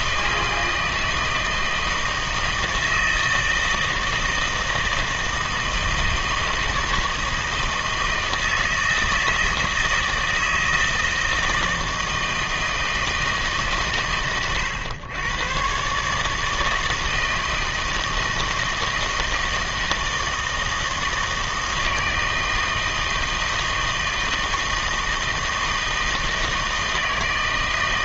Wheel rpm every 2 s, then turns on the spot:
160, 160, 160, 160, 160, 160, 160, 110, 160, 160, 160, 160, 160, 160.
none